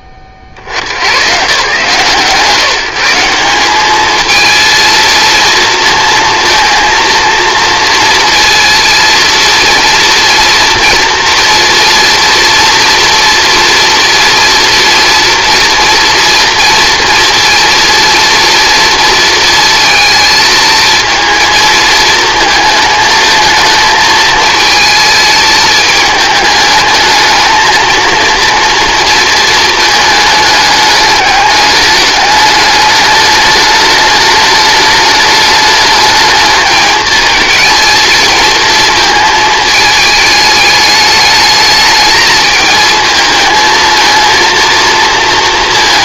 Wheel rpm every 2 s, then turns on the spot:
30, 160, 220, 230, 230, 230, 240, 230, 230, 230, 230, 220, 220, 210, 230, 210, 210, 210, 220, 230, 210, 220, 230.
none